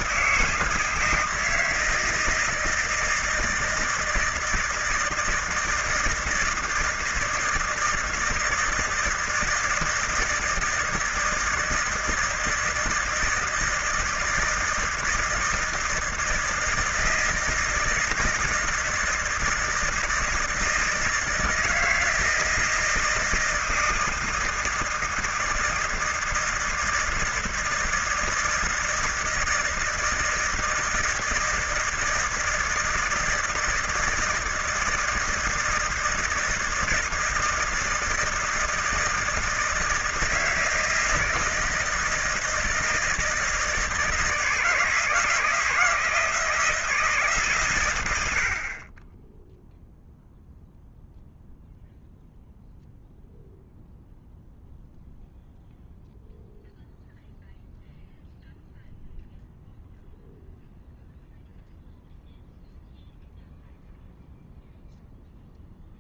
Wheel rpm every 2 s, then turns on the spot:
160, 160, 160, 160, 160, 160, 160, 160, 160, 160, 160, 160, 160, 160, 160, 160, 160, 160, 160, 160, 160, 170, 160, 160, 50, 0, 0, 0, 0, 0, 0, 0, 0.
none